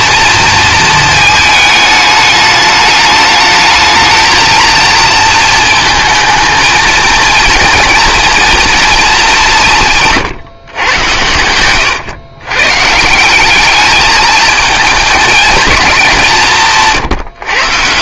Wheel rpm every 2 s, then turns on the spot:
220, 210, 220, 230, 230, 120, 140, 220, 160.
16-18